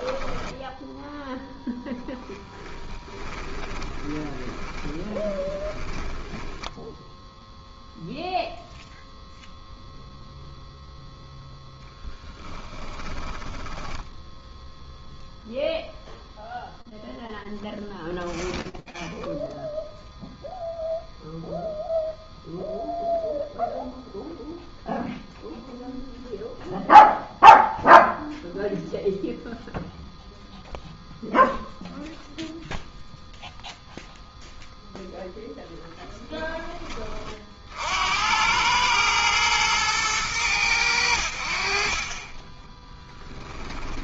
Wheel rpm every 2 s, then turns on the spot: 10, 10, 10, 10, 0, 0, 20, 0, 0, 0, 0, 0, 0, 0, 0, 0, 0, 10, 40, 110, 70, 10.
2-6 12-14 34-36 42-44